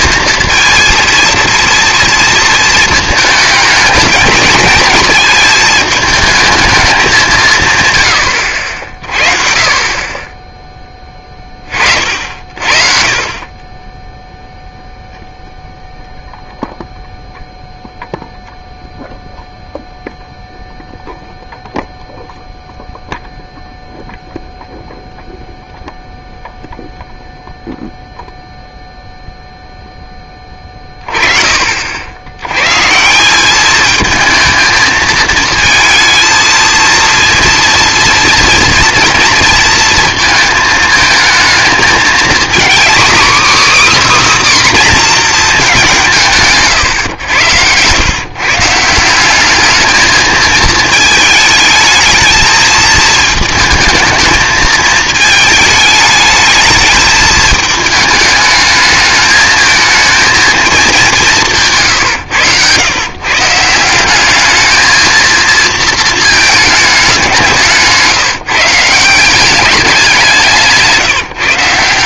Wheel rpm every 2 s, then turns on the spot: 230, 220, 210, 210, 70, 10, 40, 0, 0, 0, 0, 0, 0, 0, 0, 30, 130, 220, 230, 230, 220, 250, 280, 130, 160, 220, 220, 220, 220, 210, 220, 120, 210, 210, 160, 160.
46-48